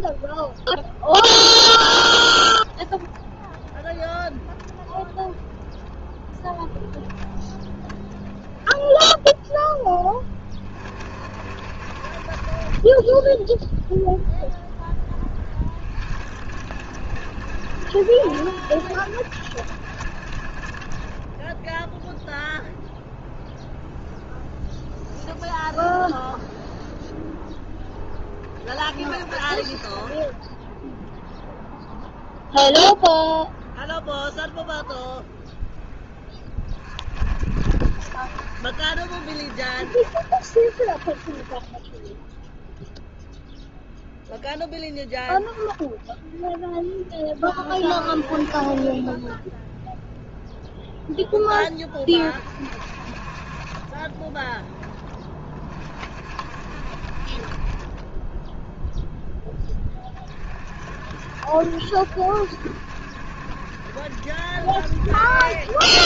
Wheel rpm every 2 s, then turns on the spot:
0, 10, 10, 20, 10, 30, 30, 0, 60, 50, 30, 0, 0, 0, 30, 10, 0, 0, 30, 60, 50, 0, 0, 10, 20, 0, 40, 20, 40, 0, 50, 70, 70.
none